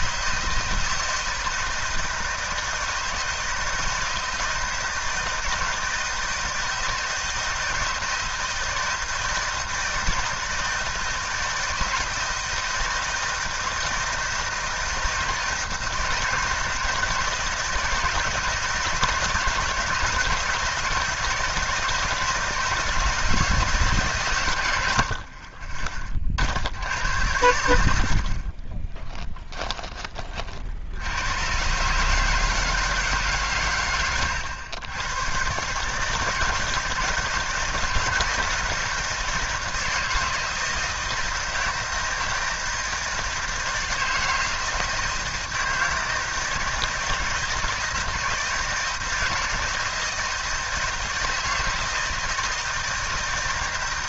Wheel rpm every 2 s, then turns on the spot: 160, 160, 160, 160, 160, 160, 160, 160, 160, 150, 160, 160, 120, 50, 30, 40, 150, 110, 160, 170, 170, 160, 160, 160, 160, 160, 160.
none